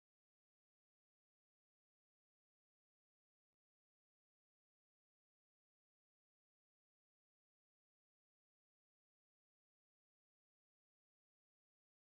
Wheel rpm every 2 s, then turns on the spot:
0, 0, 0, 0, 0, 0.
none